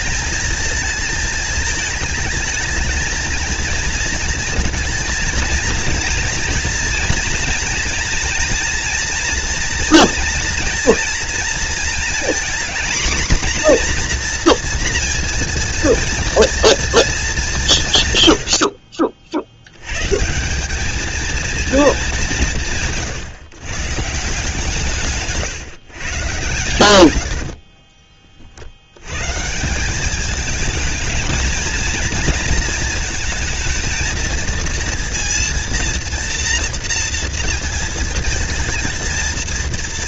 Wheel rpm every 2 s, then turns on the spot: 220, 230, 230, 230, 240, 230, 240, 230, 220, 60, 220, 150, 140, 100, 100, 210, 230, 230, 230, 230.
26-28